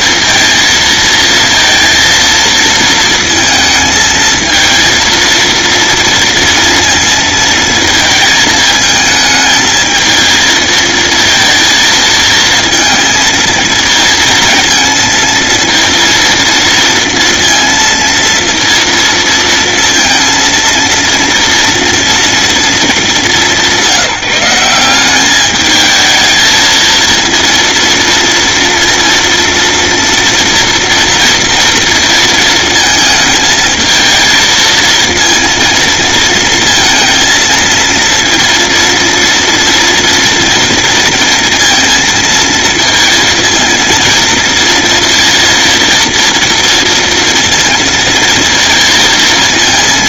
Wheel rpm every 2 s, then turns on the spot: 230, 220, 230, 230, 220, 230, 230, 230, 230, 230, 230, 210, 200, 230, 230, 230, 220, 230, 230, 230, 230, 230, 230, 230, 230.
none